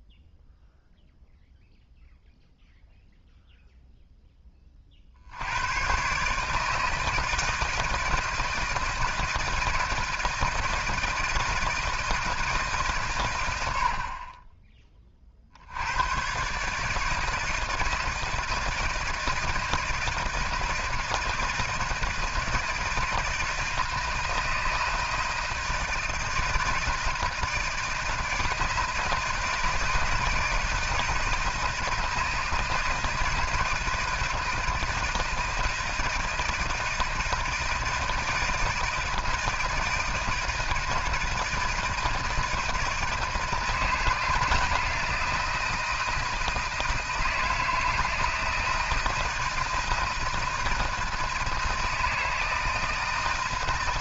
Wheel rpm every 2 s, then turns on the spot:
0, 0, 40, 160, 160, 160, 150, 40, 160, 170, 160, 160, 160, 160, 160, 160, 160, 160, 160, 160, 160, 160, 160, 160, 160, 160, 160.
none